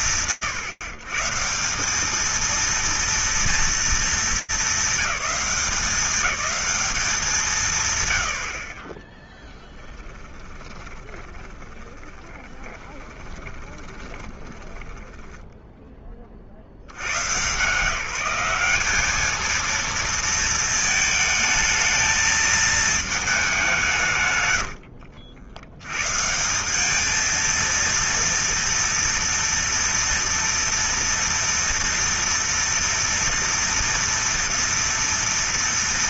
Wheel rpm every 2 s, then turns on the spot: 150, 230, 200, 210, 20, 20, 20, 20, 120, 210, 220, 220, 80, 220, 230, 230, 230, 230.
10-16